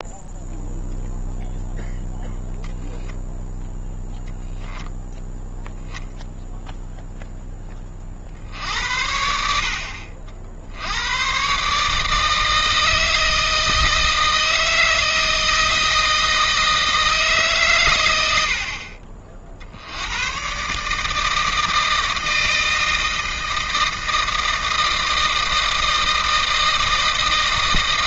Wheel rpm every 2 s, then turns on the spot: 0, 0, 0, 0, 70, 80, 160, 160, 160, 60, 140, 160, 160, 160.
none